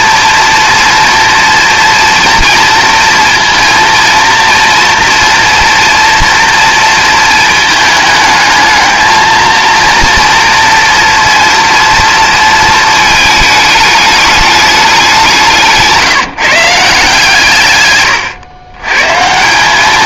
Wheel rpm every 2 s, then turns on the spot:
230, 230, 230, 230, 220, 230, 230, 200, 170, 120.
none